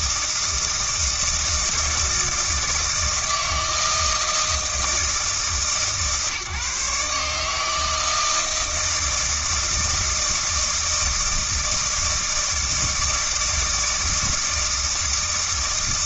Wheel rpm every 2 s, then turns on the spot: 160, 160, 160, 150, 160, 160, 160, 160.
none